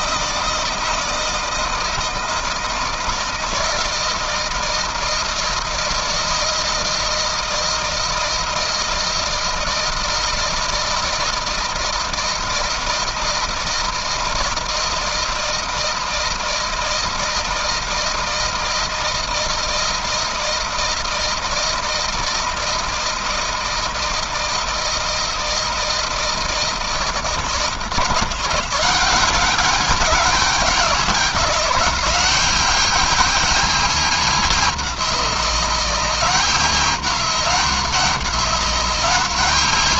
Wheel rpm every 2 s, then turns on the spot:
160, 160, 160, 160, 160, 160, 170, 160, 160, 160, 160, 160, 160, 160, 170, 200, 200, 210, 190, 190.
none